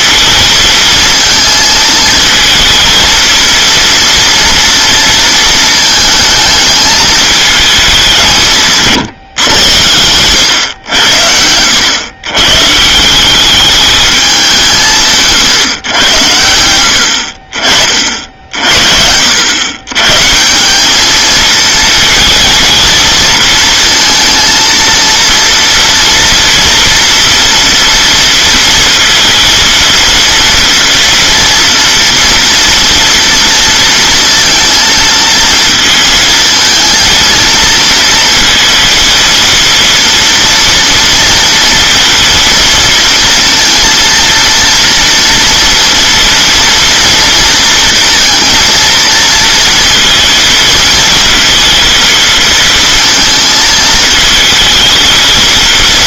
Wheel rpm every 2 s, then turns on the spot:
230, 230, 230, 220, 150, 90, 150, 180, 80, 60, 200, 230, 230, 230, 230, 230, 230, 230, 220, 230, 230, 230, 230, 230, 230, 220, 230, 220.
8-10